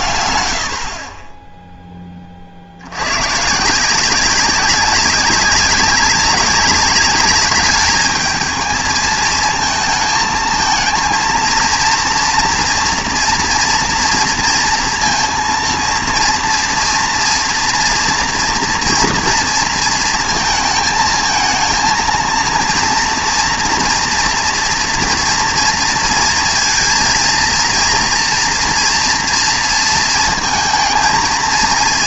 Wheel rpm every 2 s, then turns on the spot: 100, 60, 190, 200, 220, 220, 230, 230, 230, 230, 220, 230, 230, 230, 230, 220.
none